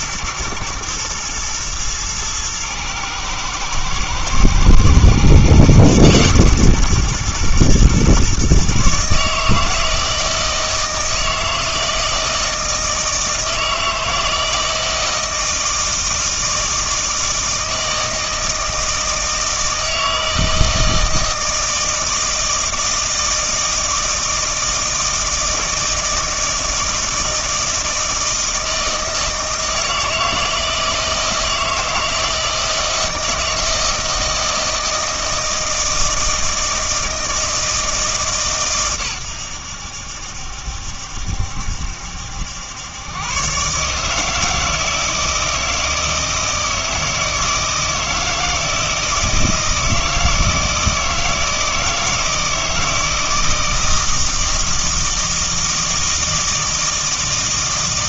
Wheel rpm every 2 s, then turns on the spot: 110, 110, 120, 130, 140, 160, 160, 160, 160, 160, 160, 160, 160, 160, 160, 160, 160, 160, 160, 130, 70, 100, 160, 160, 160, 160, 160, 160, 160.
none